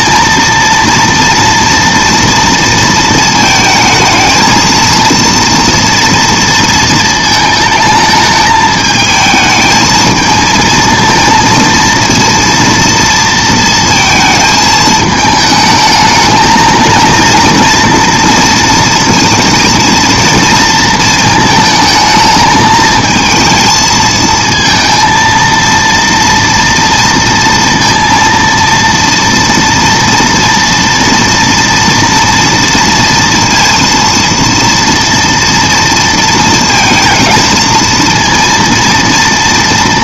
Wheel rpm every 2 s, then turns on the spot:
230, 230, 220, 230, 220, 220, 230, 220, 220, 230, 230, 220, 220, 230, 230, 230, 230, 230, 230, 230.
none